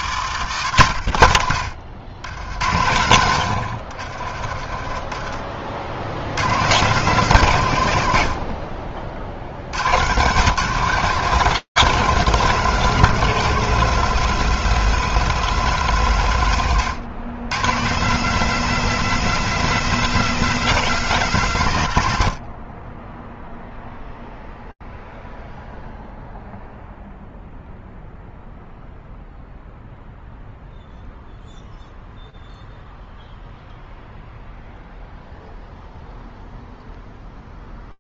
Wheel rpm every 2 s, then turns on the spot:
150, 80, 80, 50, 190, 80, 200, 200, 180, 130, 200, 120, 0, 0, 0, 0, 0, 0, 0.
none